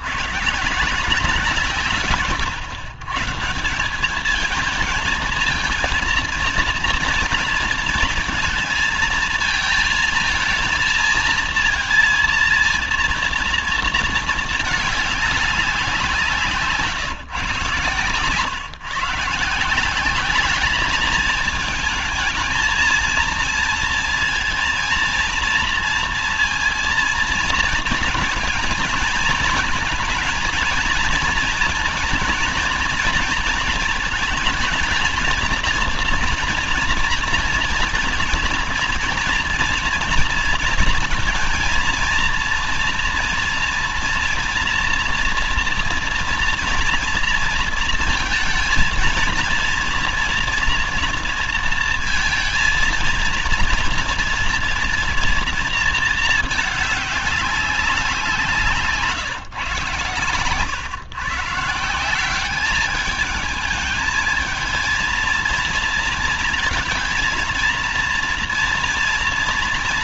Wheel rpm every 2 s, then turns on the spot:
160, 130, 220, 230, 220, 220, 230, 210, 150, 130, 200, 220, 230, 230, 220, 230, 230, 220, 230, 230, 230, 230, 240, 230, 230, 240, 230, 230, 220, 170, 130, 200, 220, 230, 230.
none